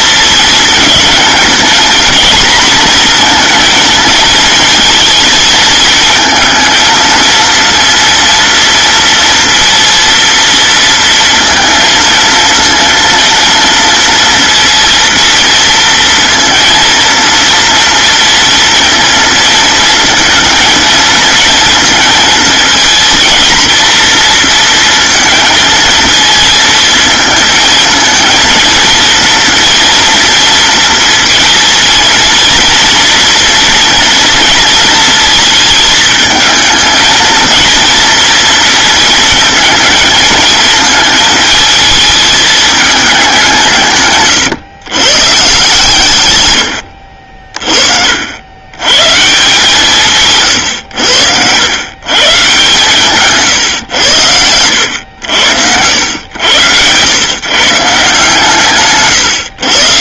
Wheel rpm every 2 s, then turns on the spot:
220, 240, 220, 230, 230, 230, 230, 230, 230, 230, 230, 230, 230, 230, 230, 230, 230, 230, 220, 230, 220, 210, 140, 100, 90, 140, 130, 100, 100, 150.
none